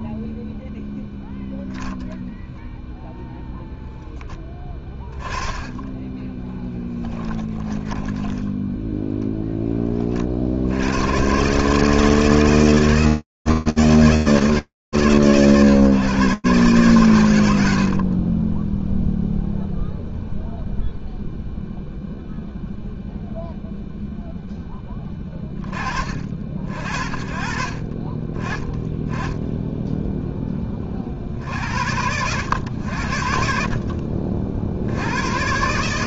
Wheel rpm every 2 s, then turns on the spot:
0, 0, 20, 10, 10, 70, 160, 130, 60, 0, 0, 0, 50, 30, 10, 80, 50, 130.
8-10